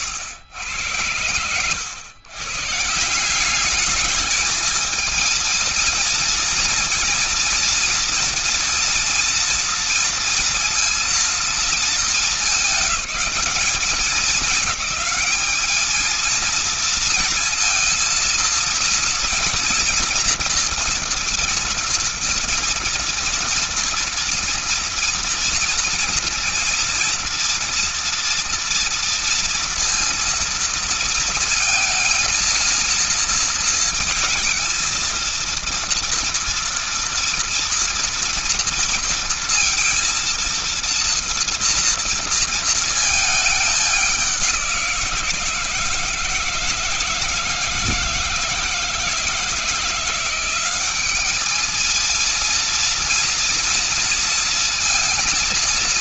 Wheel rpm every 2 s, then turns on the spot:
100, 140, 220, 230, 240, 230, 210, 210, 230, 230, 230, 230, 230, 230, 230, 230, 230, 230, 230, 230, 230, 220, 190, 160, 160, 180, 230, 230.
none